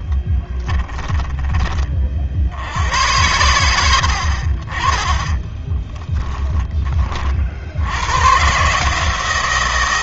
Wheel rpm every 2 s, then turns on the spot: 10, 90, 40, 20, 150.
0-2 6-8